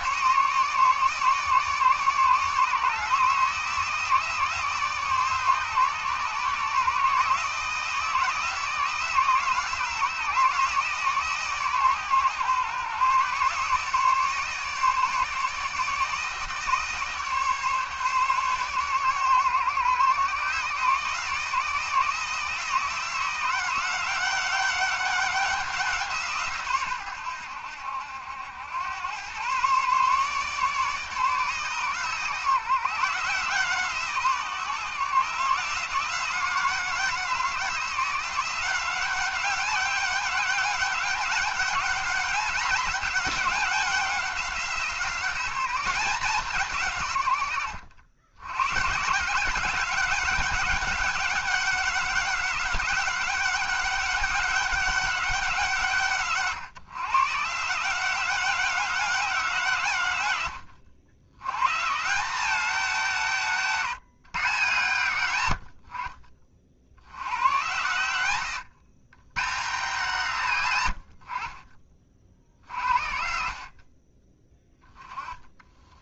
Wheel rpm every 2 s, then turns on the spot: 150, 150, 150, 150, 160, 160, 130, 150, 150, 130, 140, 160, 200, 130, 90, 150, 150, 150, 160, 180, 200, 200, 170, 160, 130, 190, 190, 200, 140, 190, 100, 200, 130, 60, 120, 120, 60, 10.
none